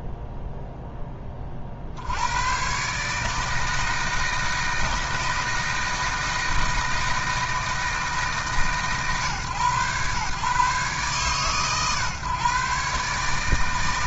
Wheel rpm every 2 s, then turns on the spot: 0, 150, 160, 160, 130, 130, 150.
none